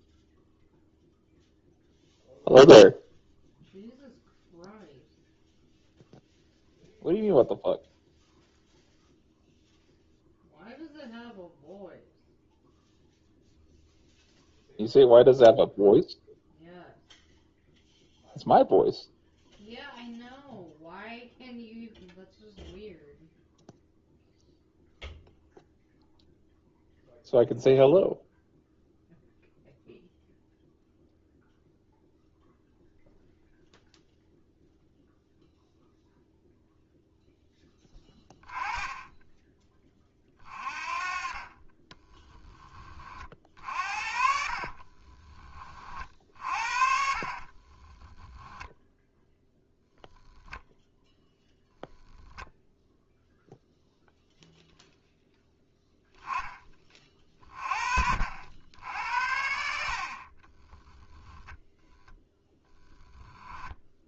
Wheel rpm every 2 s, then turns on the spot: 0, 0, 0, 0, 0, 0, 0, 0, 0, 0, 0, 0, 0, 0, 0, 0, 0, 0, 0, 10, 30, 30, 40, 60, 10, 0, 0, 0, 30, 80, 20, 0.
44-48 60-62